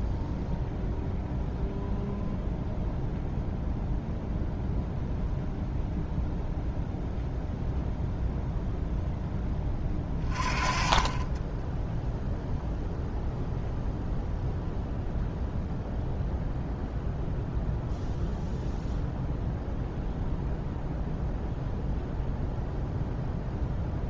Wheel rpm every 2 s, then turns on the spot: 0, 0, 0, 0, 0, 30, 0, 0, 0, 0, 0, 0.
none